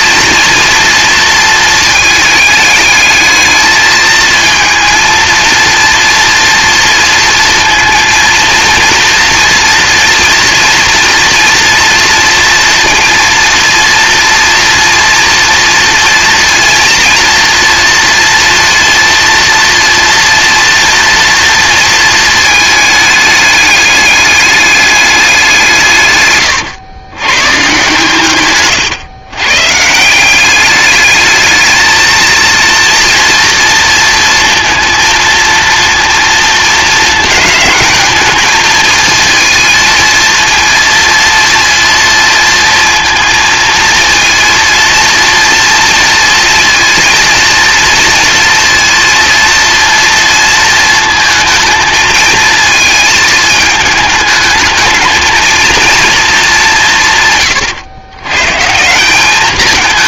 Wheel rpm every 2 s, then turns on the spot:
230, 220, 230, 230, 230, 240, 230, 230, 230, 230, 240, 220, 210, 130, 130, 200, 230, 230, 220, 230, 230, 230, 230, 230, 240, 230, 220, 220, 180, 160.
none